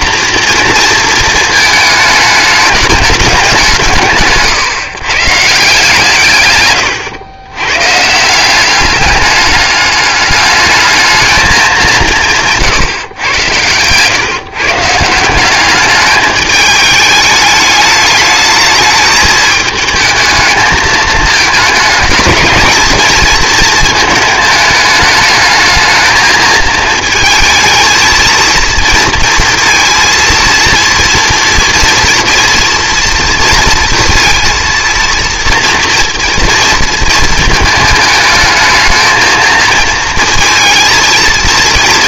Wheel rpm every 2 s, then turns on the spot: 230, 210, 120, 120, 190, 210, 160, 140, 210, 210, 220, 210, 220, 220, 230, 230, 230, 230, 230, 220, 230.
none